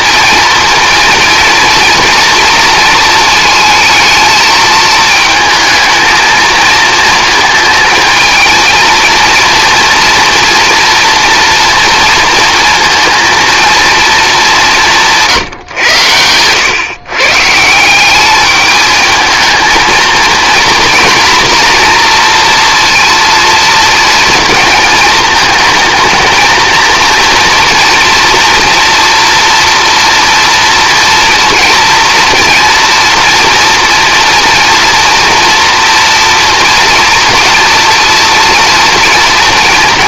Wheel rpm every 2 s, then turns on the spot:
230, 230, 220, 220, 230, 240, 230, 200, 110, 210, 240, 230, 220, 230, 230, 230, 230, 230, 230, 230.
none